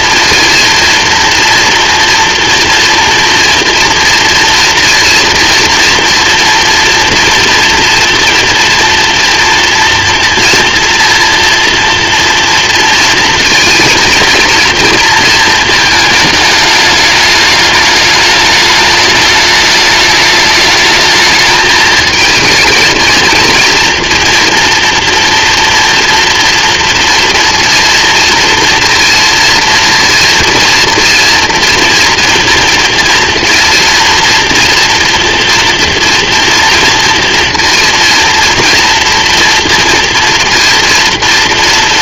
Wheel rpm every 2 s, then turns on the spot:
230, 230, 230, 230, 240, 230, 230, 230, 210, 210, 220, 230, 240, 230, 230, 230, 230, 230, 230, 230, 230.
none